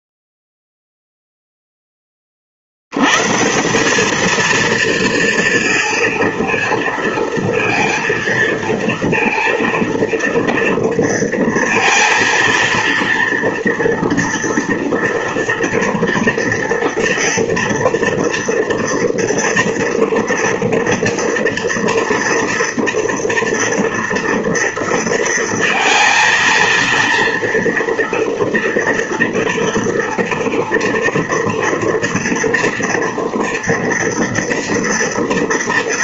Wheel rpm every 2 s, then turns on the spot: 0, 60, 220, 230, 230, 230, 230, 230, 230, 230, 230, 230, 230, 230, 230, 230, 230, 230.
none